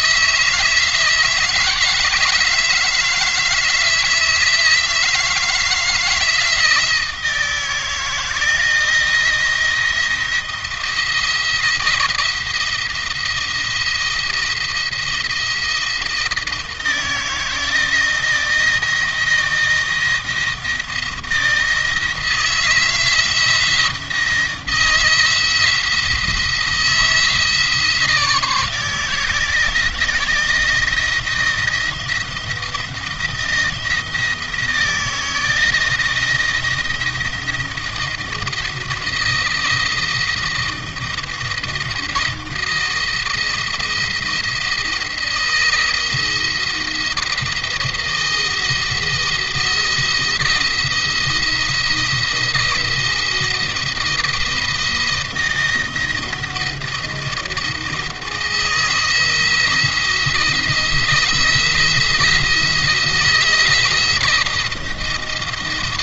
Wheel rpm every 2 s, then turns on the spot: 160, 160, 160, 170, 170, 170, 170, 170, 160, 170, 170, 160, 170, 170, 160, 160, 170, 160, 170, 170, 170, 170, 170, 170, 170, 170, 170, 170, 170, 170, 170, 160, 160.
none